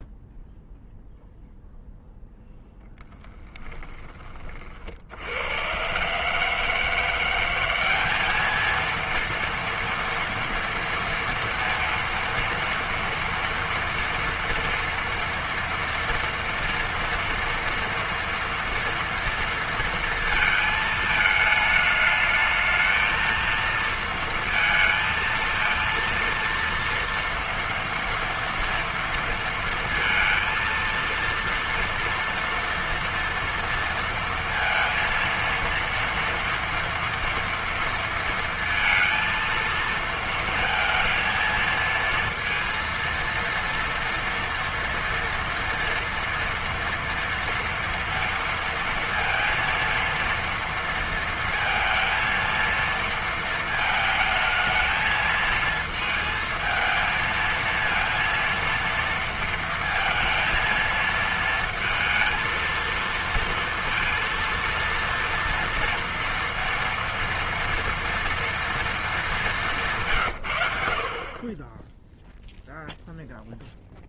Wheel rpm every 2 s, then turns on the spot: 0, 0, 50, 160, 220, 230, 230, 230, 230, 230, 220, 220, 230, 230, 230, 230, 230, 230, 230, 230, 220, 230, 230, 230, 230, 230, 230, 220, 220, 230, 230, 230, 230, 230, 230, 100, 0.
none